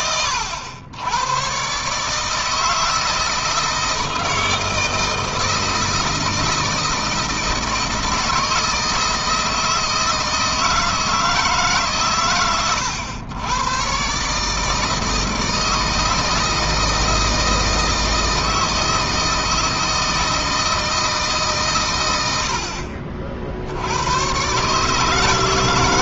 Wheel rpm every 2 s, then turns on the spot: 90, 160, 160, 160, 160, 160, 110, 150, 160, 160, 160, 60, 130.
none